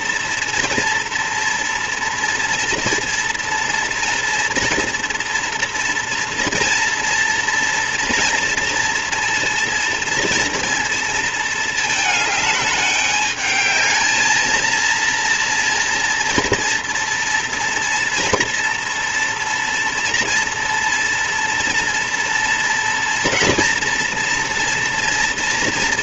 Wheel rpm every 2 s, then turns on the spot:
230, 230, 230, 230, 230, 230, 210, 230, 230, 230, 230, 230, 230.
none